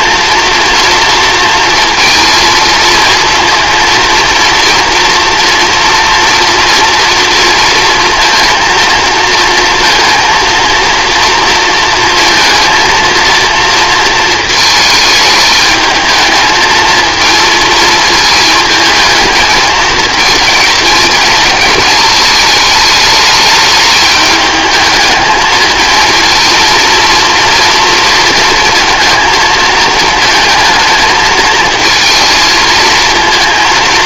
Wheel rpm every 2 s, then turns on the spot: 240, 230, 230, 230, 230, 230, 230, 220, 220, 220, 220, 220, 210, 230, 230, 220, 220.
none